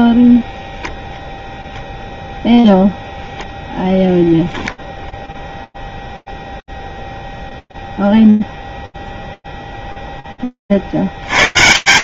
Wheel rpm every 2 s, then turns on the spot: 0, 0, 0, 0, 0, 140.
none